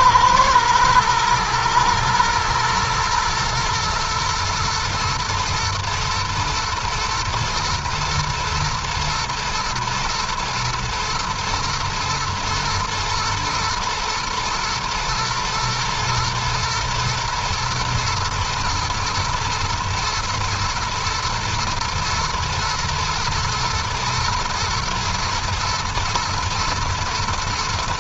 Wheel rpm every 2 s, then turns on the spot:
110, 120, 110, 110, 120, 120, 120, 120, 120, 110, 110, 120, 110, 110.
none